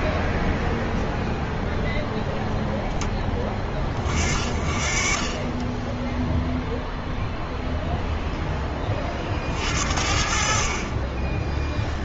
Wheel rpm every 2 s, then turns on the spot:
0, 0, 40, 0, 10, 40.
4-6